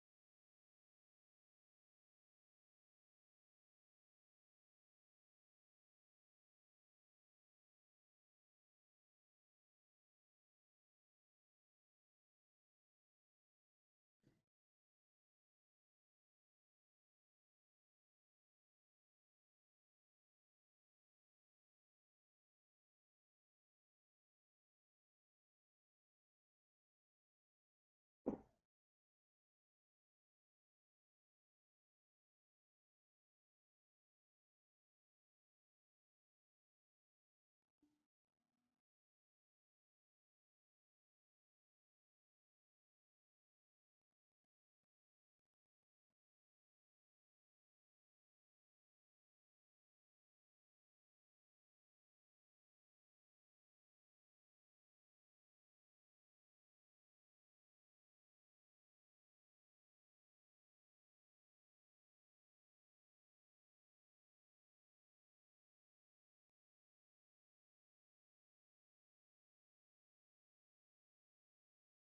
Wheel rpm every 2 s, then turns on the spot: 0, 0, 0, 0, 0, 0, 0, 0, 0, 0, 0, 0, 0, 0, 0, 0, 0, 0, 0, 0, 0, 0, 0, 0, 0, 0, 0, 0, 0, 0, 0, 0, 0, 0, 0, 0.
none